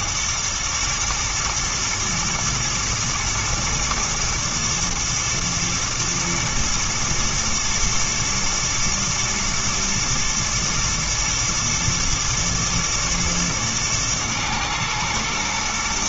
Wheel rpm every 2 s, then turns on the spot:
110, 120, 120, 120, 110, 120, 120, 120.
none